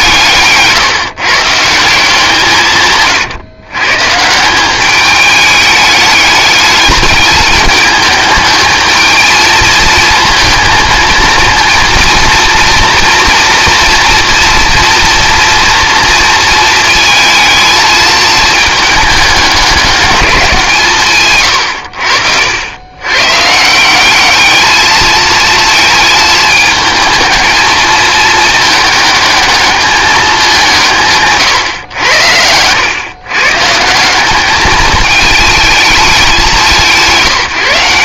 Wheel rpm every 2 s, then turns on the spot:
150, 130, 200, 210, 220, 230, 230, 240, 220, 210, 140, 110, 220, 220, 220, 160, 110, 220, 160.
2-4